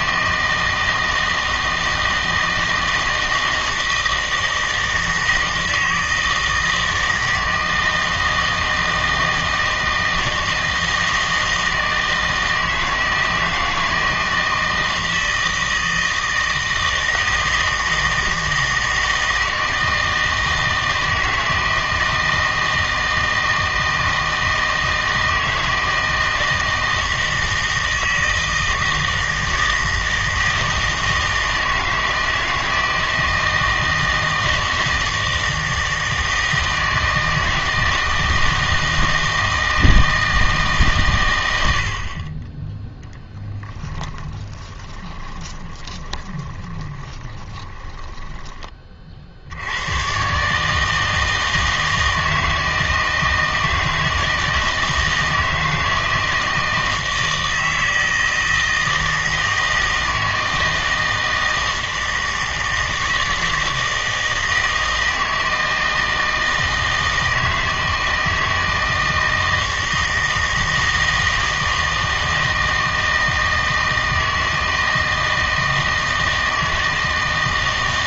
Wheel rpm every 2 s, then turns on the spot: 160, 160, 160, 160, 160, 160, 160, 160, 160, 160, 160, 160, 160, 160, 160, 160, 160, 160, 160, 160, 140, 10, 20, 20, 20, 150, 160, 160, 160, 160, 160, 160, 160, 160, 160, 160, 160, 160, 160.
44-48